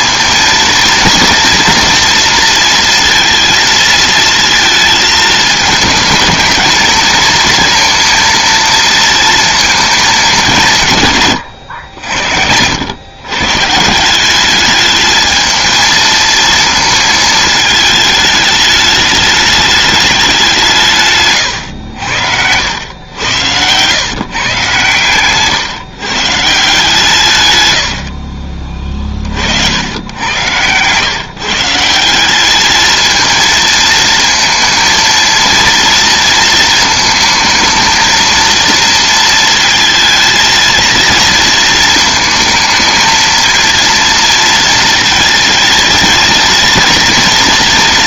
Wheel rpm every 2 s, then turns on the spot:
230, 230, 220, 220, 230, 160, 90, 210, 230, 210, 180, 90, 130, 160, 40, 120, 210, 230, 220, 230, 220, 220, 230, 230.
none